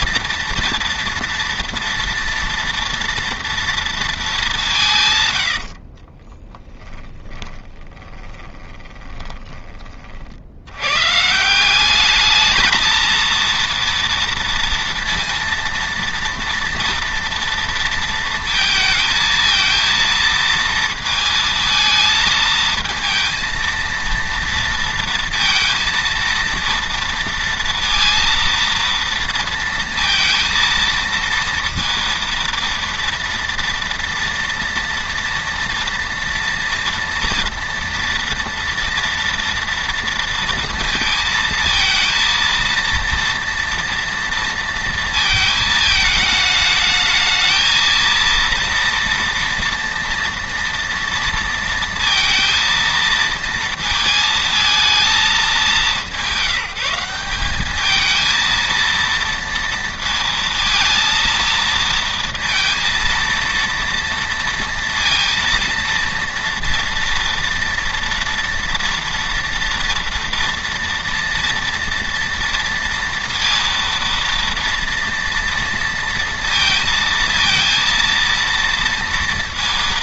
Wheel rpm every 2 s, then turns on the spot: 230, 230, 180, 10, 20, 90, 220, 230, 230, 220, 230, 220, 230, 230, 230, 230, 230, 240, 230, 230, 230, 230, 230, 220, 230, 230, 230, 220, 190, 230, 230, 230, 230, 230, 230, 230, 230, 230, 230, 230.
6-10